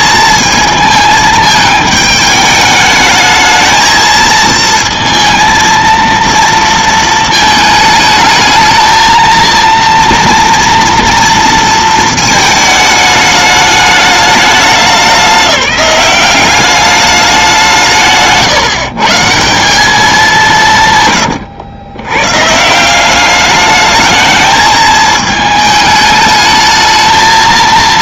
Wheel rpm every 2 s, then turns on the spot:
220, 210, 230, 230, 220, 230, 220, 200, 200, 140, 150, 170, 220, 220.
none